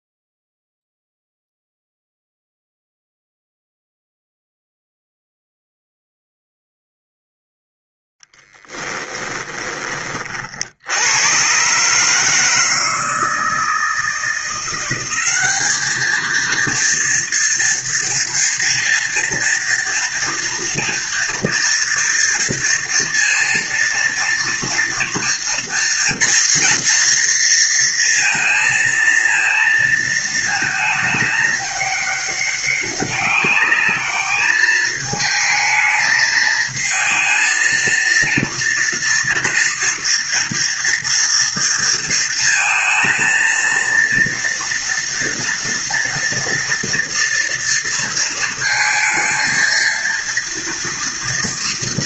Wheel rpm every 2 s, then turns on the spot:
0, 0, 0, 0, 10, 70, 160, 180, 230, 230, 230, 230, 230, 230, 230, 220, 200, 220, 220, 230, 230, 230, 230, 230, 230, 230.
8-10